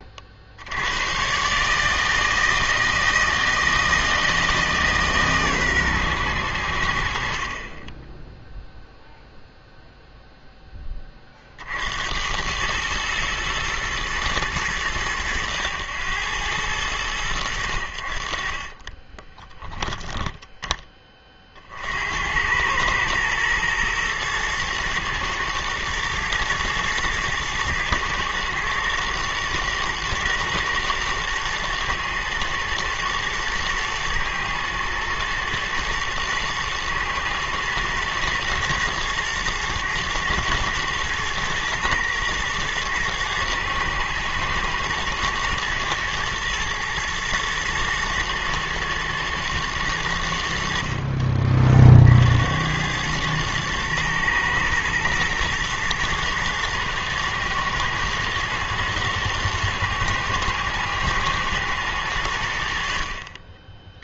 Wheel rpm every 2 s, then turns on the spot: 70, 160, 160, 90, 0, 10, 100, 110, 100, 40, 10, 100, 120, 110, 110, 120, 110, 110, 120, 110, 110, 110, 110, 110, 120, 70, 90, 110, 110, 120, 120, 80.
18-20